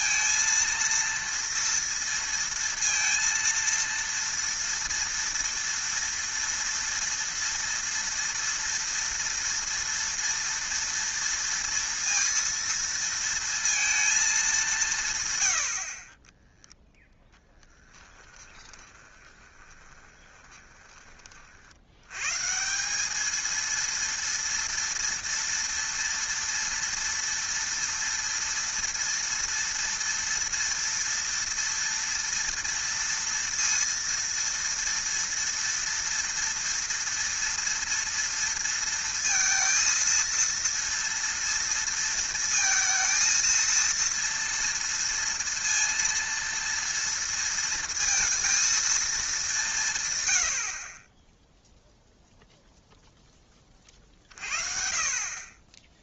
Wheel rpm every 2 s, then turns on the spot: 230, 230, 230, 230, 230, 230, 230, 190, 0, 20, 20, 160, 230, 230, 230, 230, 230, 230, 230, 230, 230, 230, 230, 230, 230, 70, 0, 50.
18-22